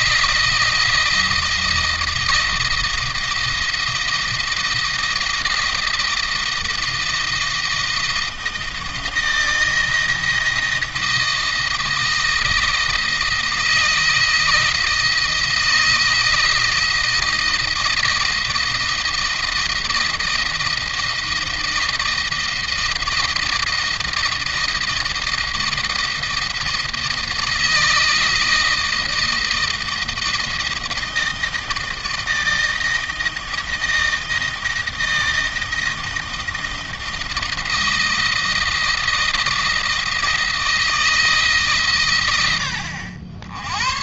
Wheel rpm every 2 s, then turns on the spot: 170, 160, 160, 160, 160, 160, 160, 160, 170, 160, 170, 160, 160, 160, 160, 160, 160, 160, 160, 160, 160, 90.
none